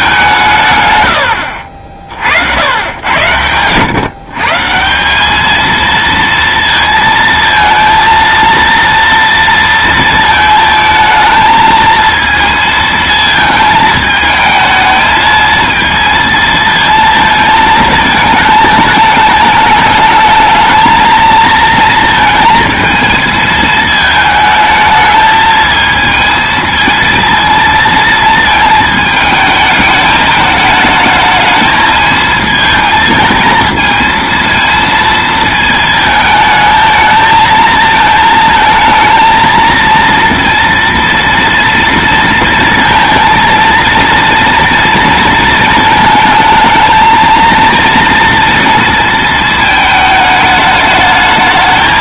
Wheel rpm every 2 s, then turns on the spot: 120, 100, 170, 230, 230, 220, 220, 220, 230, 220, 220, 220, 220, 220, 220, 210, 220, 230, 220, 230, 230, 230, 230, 220, 230, 210.
none